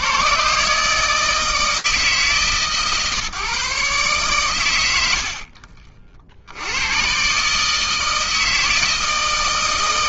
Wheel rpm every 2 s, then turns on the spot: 150, 140, 70, 160, 160.
none